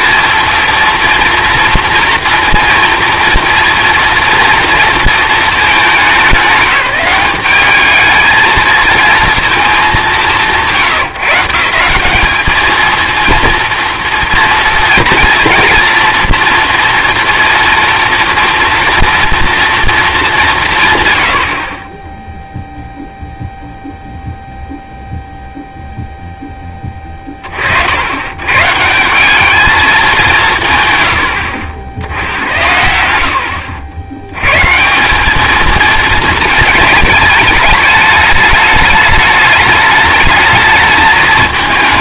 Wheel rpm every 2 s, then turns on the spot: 230, 230, 230, 190, 230, 120, 220, 230, 230, 240, 170, 0, 0, 10, 140, 140, 80, 150, 220, 210, 220.
none